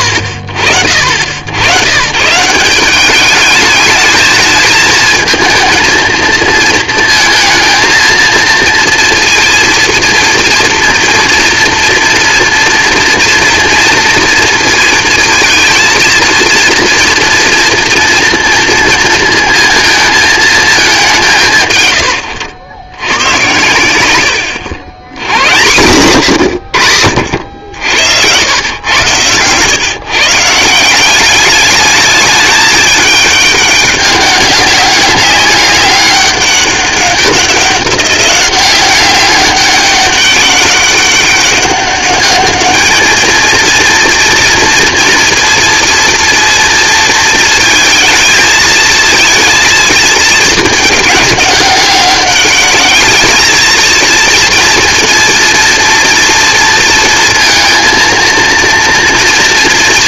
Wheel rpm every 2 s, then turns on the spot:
50, 170, 220, 230, 230, 230, 230, 230, 230, 230, 210, 100, 80, 100, 110, 170, 210, 200, 200, 190, 200, 210, 230, 230, 220, 210, 200, 230, 230, 230.
none